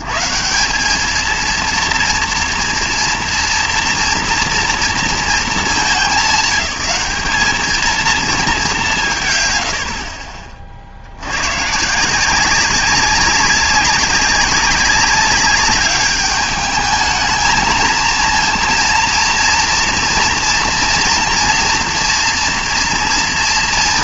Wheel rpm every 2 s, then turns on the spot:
140, 230, 240, 210, 210, 40, 180, 190, 210, 230, 240, 230.
none